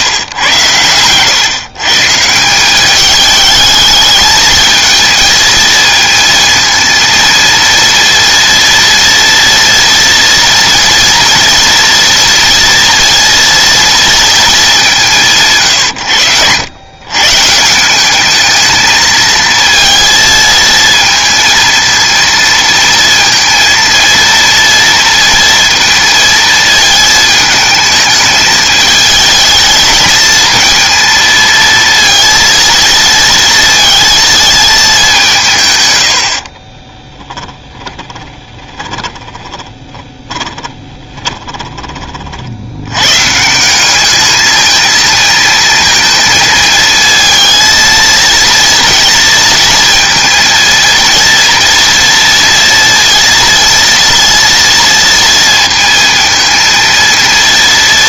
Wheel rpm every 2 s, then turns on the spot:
110, 200, 230, 230, 230, 230, 230, 190, 120, 220, 230, 230, 230, 220, 220, 230, 230, 210, 30, 20, 20, 70, 220, 220, 230, 230, 230, 230, 220.
0-2 36-42